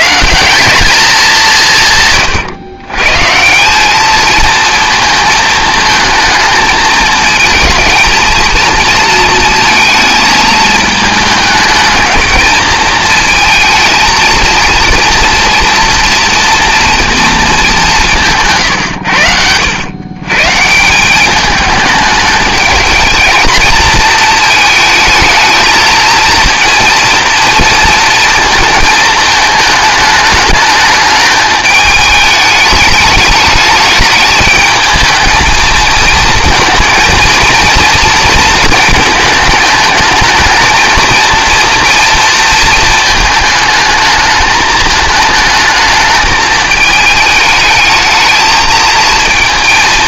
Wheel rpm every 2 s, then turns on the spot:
190, 130, 220, 220, 230, 220, 220, 230, 230, 130, 150, 220, 220, 230, 220, 210, 210, 210, 230, 230, 220, 220, 220, 220, 220.
none